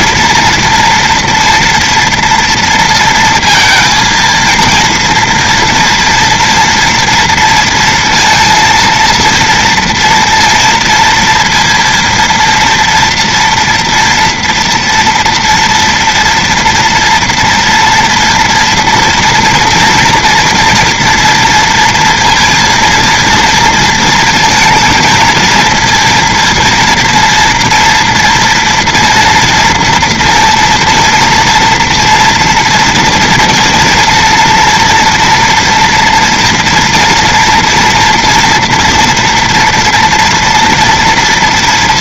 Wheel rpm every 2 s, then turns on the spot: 230, 230, 230, 230, 230, 230, 230, 230, 230, 230, 240, 230, 230, 230, 240, 230, 230, 230, 240, 230, 240.
none